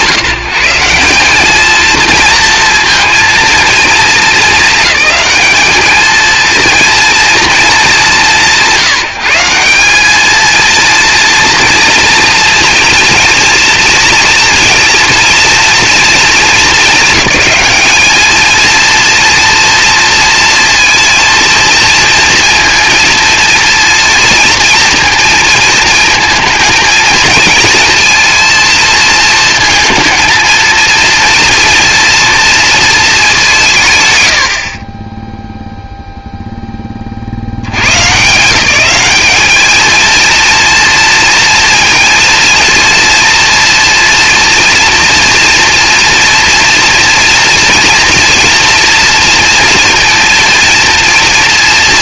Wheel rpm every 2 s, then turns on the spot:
160, 230, 220, 230, 160, 230, 230, 230, 210, 230, 230, 230, 230, 220, 230, 220, 230, 40, 0, 180, 230, 230, 230, 240, 230, 230.
none